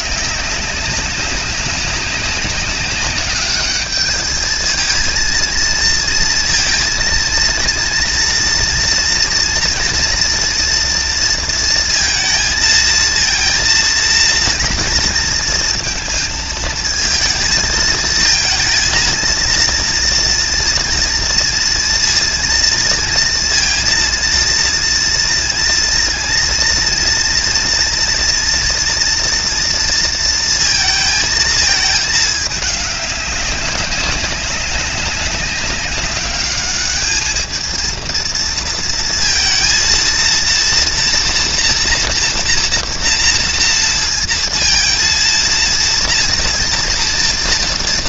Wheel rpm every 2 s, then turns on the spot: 190, 200, 220, 230, 230, 230, 230, 230, 220, 230, 230, 230, 230, 230, 230, 230, 210, 190, 210, 230, 230, 230, 230, 230.
none